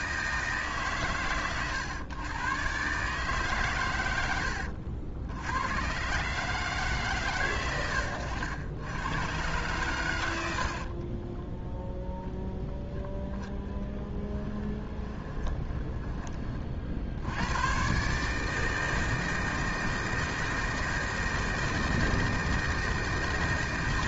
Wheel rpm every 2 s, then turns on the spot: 140, 130, 80, 140, 100, 50, 10, 20, 40, 160, 160, 160.
10-12 14-16